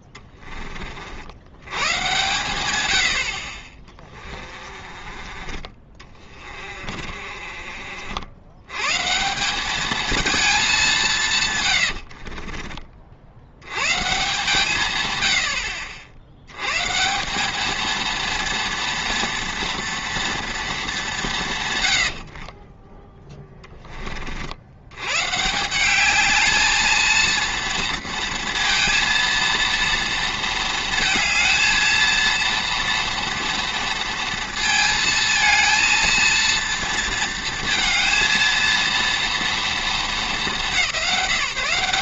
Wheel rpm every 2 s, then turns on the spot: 30, 110, 30, 40, 130, 200, 30, 120, 140, 230, 230, 40, 70, 220, 230, 220, 230, 230, 230, 220, 180.
4-8 22-24